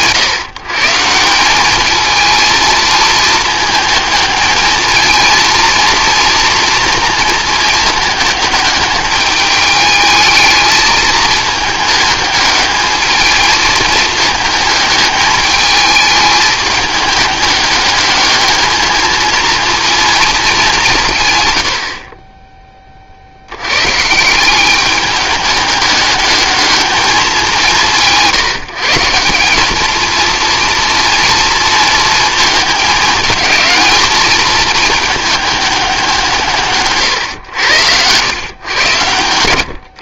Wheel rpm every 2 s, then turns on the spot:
150, 220, 220, 230, 210, 220, 220, 210, 210, 220, 180, 30, 190, 210, 160, 230, 220, 220, 140, 110.
none